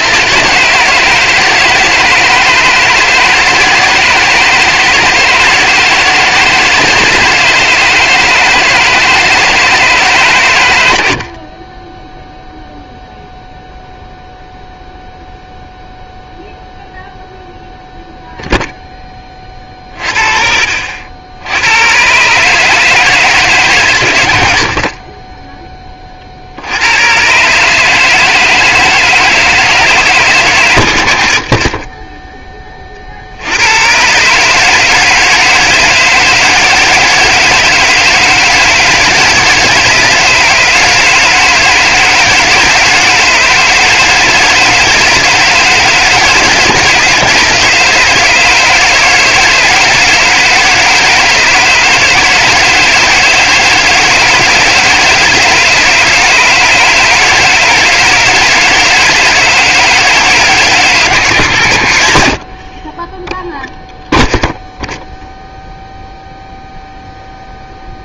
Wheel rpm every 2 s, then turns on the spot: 160, 160, 160, 160, 160, 100, 0, 0, 0, 0, 50, 150, 50, 80, 160, 110, 20, 150, 160, 160, 150, 160, 160, 160, 160, 160, 160, 160, 150, 160, 150, 40, 0, 0.
62-64